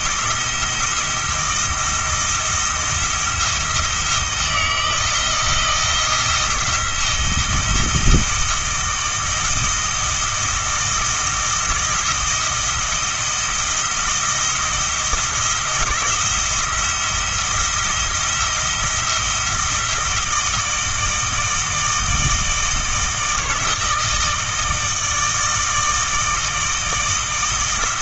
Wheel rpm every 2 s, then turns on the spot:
170, 170, 160, 170, 160, 160, 160, 170, 170, 170, 160, 160, 160, 160.
none